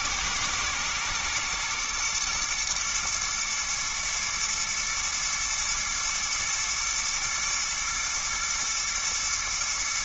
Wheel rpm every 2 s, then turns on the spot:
110, 120, 110, 110, 110.
none